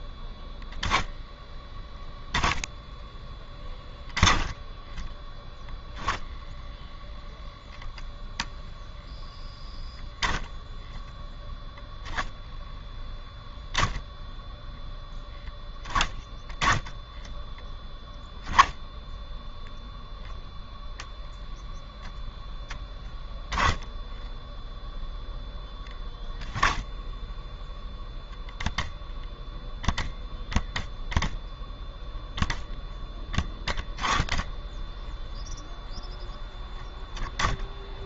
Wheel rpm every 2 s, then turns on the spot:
10, 10, 10, 0, 0, 10, 10, 10, 10, 10, 10, 0, 0, 10, 0, 10, 20, 10, 10.
none